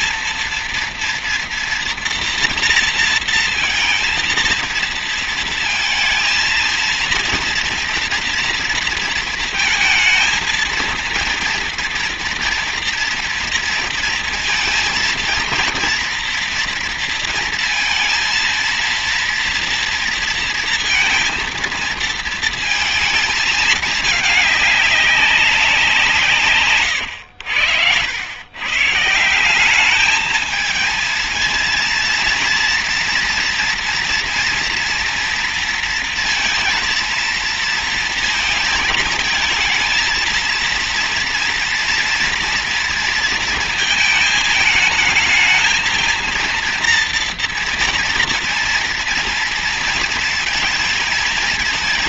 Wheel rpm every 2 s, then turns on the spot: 230, 230, 230, 230, 230, 230, 230, 230, 230, 230, 230, 220, 200, 130, 160, 230, 230, 230, 230, 220, 230, 230, 220, 230, 230, 220.
none